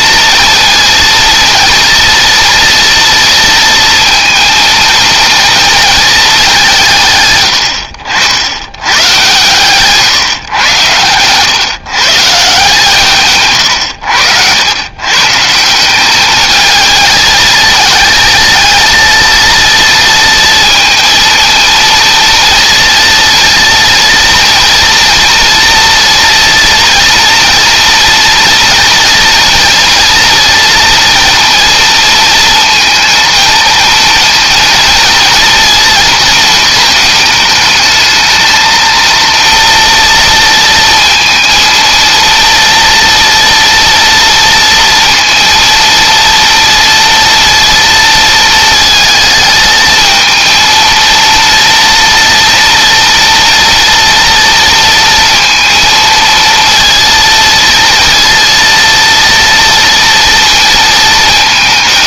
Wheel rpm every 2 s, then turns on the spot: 230, 230, 230, 140, 110, 110, 150, 130, 220, 230, 230, 230, 230, 230, 240, 230, 230, 230, 220, 230, 230, 230, 230, 230, 220, 230, 230, 230, 230, 230, 220.
none